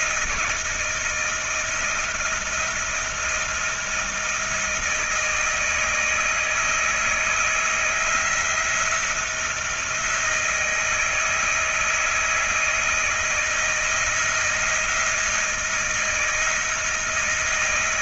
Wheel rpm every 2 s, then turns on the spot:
160, 170, 170, 160, 170, 160, 160, 170, 160.
none